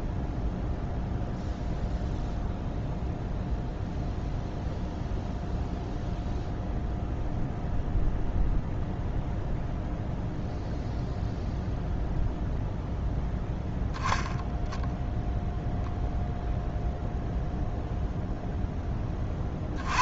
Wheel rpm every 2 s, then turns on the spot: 0, 0, 0, 0, 0, 0, 0, 0, 0, 0.
none